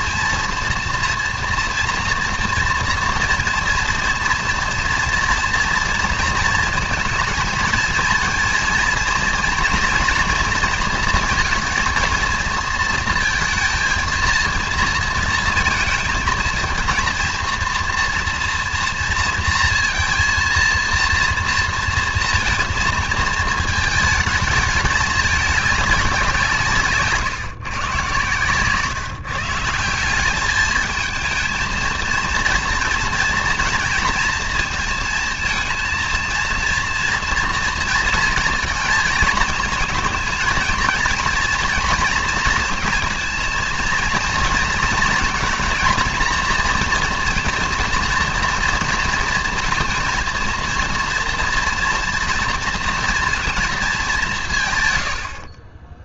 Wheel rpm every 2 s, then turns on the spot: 230, 240, 230, 230, 230, 230, 230, 230, 230, 230, 230, 230, 210, 150, 140, 220, 230, 220, 230, 230, 230, 230, 230, 230, 230, 230, 230, 130.
none